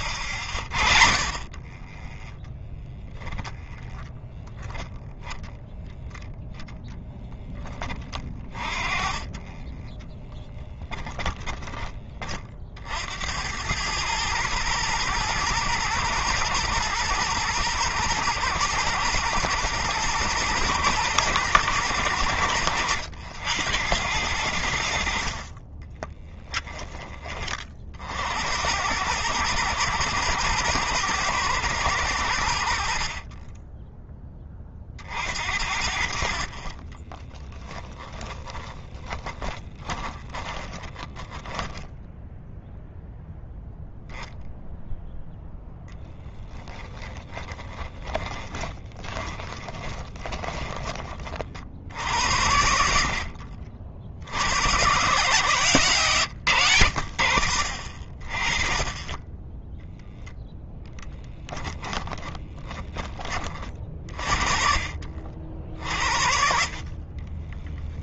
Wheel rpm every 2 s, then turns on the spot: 30, 10, 0, 10, 30, 10, 80, 110, 120, 110, 120, 90, 60, 20, 100, 120, 60, 50, 20, 20, 20, 0, 0, 10, 20, 30, 70, 120, 80, 10, 10, 30, 60, 30.
10-12 36-42 48-50 66-68